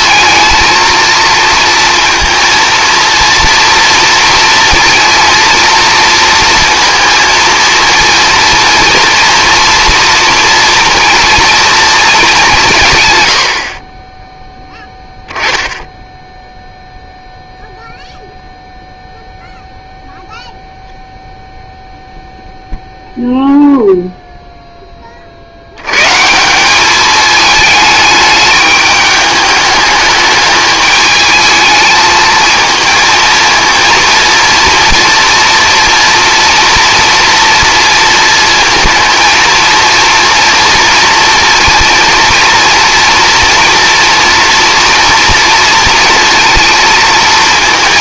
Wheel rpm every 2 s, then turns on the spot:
230, 230, 230, 230, 230, 230, 180, 10, 0, 0, 0, 0, 10, 190, 210, 210, 230, 230, 230, 230, 230, 230, 240, 230.
none